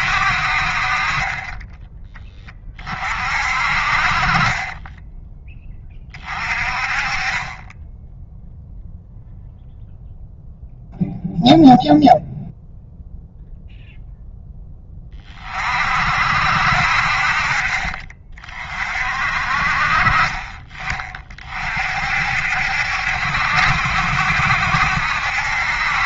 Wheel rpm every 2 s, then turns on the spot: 50, 20, 20, 30, 0, 0, 0, 10, 60, 40, 30, 70, 70.
4-6